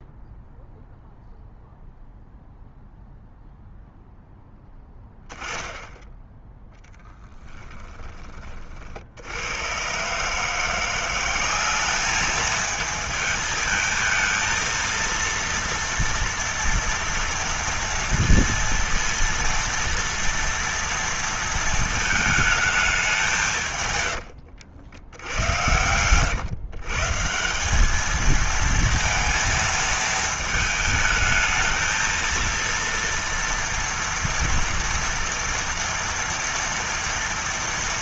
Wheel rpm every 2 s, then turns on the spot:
0, 0, 10, 10, 40, 160, 220, 230, 230, 230, 230, 220, 90, 130, 220, 220, 230, 230, 230.
24-26